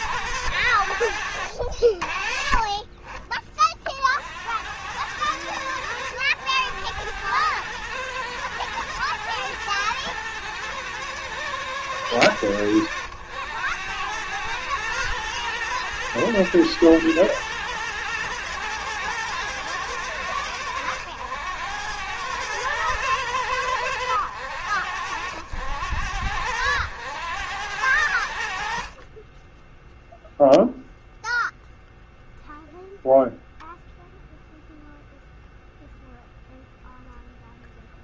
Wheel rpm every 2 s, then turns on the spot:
90, 30, 80, 100, 120, 110, 100, 110, 110, 110, 100, 110, 90, 90, 50, 0, 0, 0, 0.
none